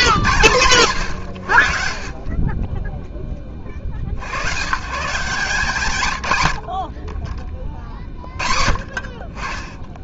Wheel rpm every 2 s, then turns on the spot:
130, 30, 110, 70, 30.
none